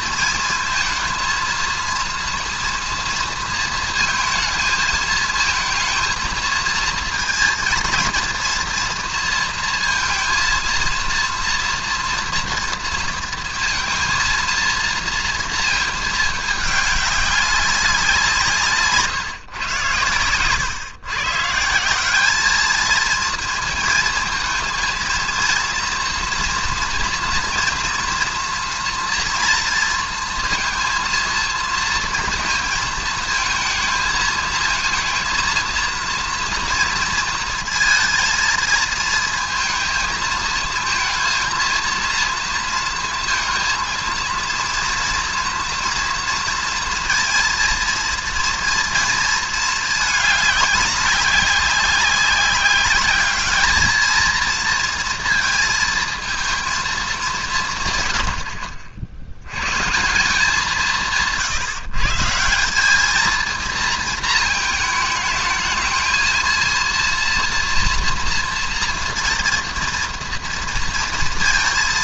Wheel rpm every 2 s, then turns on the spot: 220, 230, 220, 220, 230, 230, 230, 230, 210, 160, 120, 210, 220, 230, 240, 230, 230, 220, 230, 220, 220, 230, 230, 240, 230, 200, 200, 230, 220, 50, 180, 180, 220, 230, 240, 230.
none